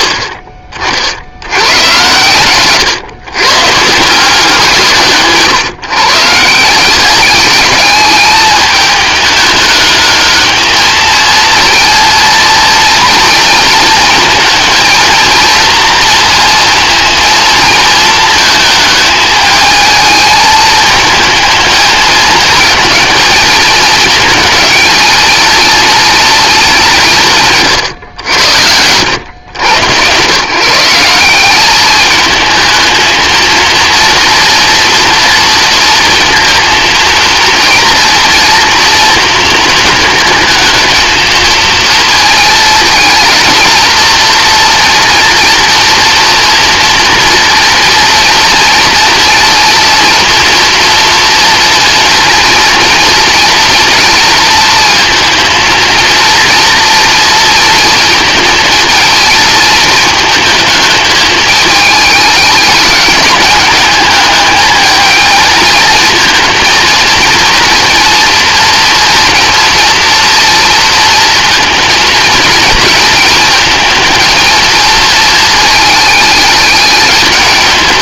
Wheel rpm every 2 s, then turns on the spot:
40, 120, 160, 180, 210, 220, 230, 220, 230, 220, 220, 220, 220, 190, 90, 170, 230, 240, 230, 230, 220, 220, 230, 230, 230, 240, 230, 230, 240, 230, 220, 210, 220, 230, 230, 230, 220, 220, 210.
none